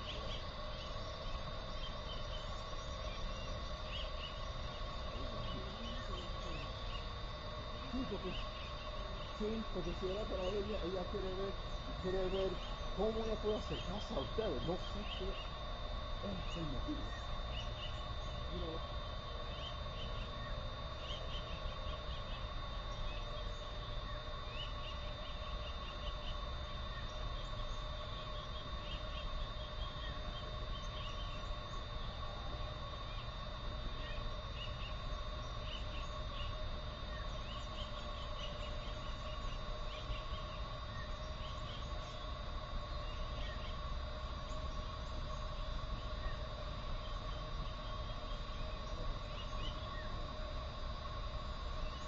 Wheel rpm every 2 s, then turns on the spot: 0, 0, 0, 0, 0, 0, 0, 0, 0, 0, 0, 0, 0, 0, 0, 0, 0, 0, 0, 0, 0, 0, 0, 0, 0, 0.
none